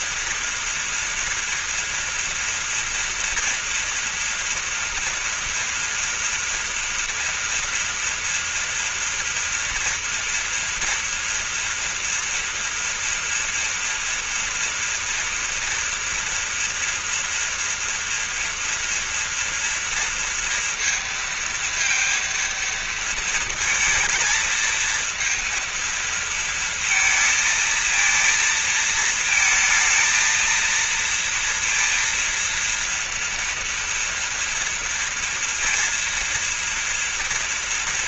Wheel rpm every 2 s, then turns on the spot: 230, 230, 230, 230, 230, 230, 240, 240, 230, 230, 230, 230, 220, 230, 220, 230, 230, 230, 230.
none